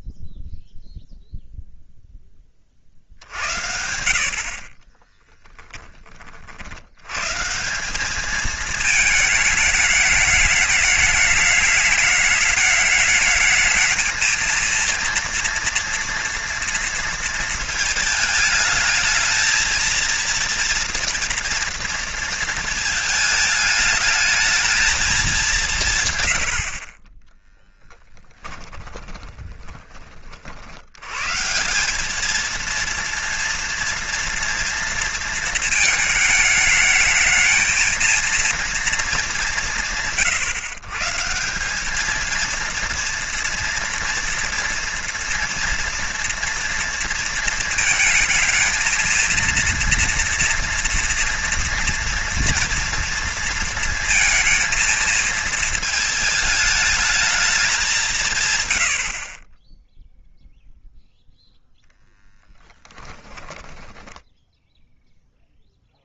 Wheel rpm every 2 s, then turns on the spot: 0, 40, 30, 90, 220, 210, 210, 230, 230, 220, 230, 220, 220, 60, 10, 70, 230, 230, 210, 230, 140, 230, 230, 230, 230, 230, 230, 220, 220, 120, 0, 10, 0.
28-30 62-64